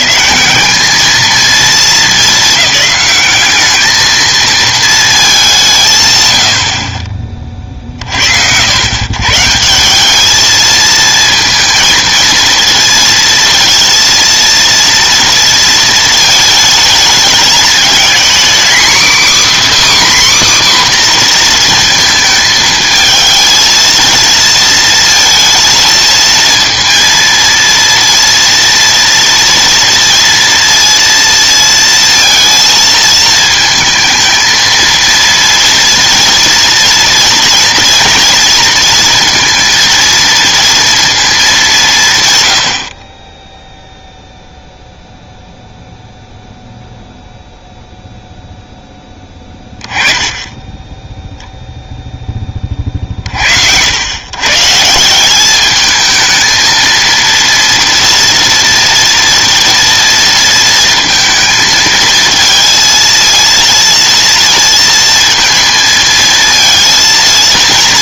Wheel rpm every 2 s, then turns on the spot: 160, 210, 220, 80, 80, 220, 230, 230, 220, 250, 280, 220, 230, 230, 230, 230, 230, 230, 230, 230, 230, 90, 0, 0, 0, 10, 20, 140, 220, 230, 230, 230, 230, 220.
none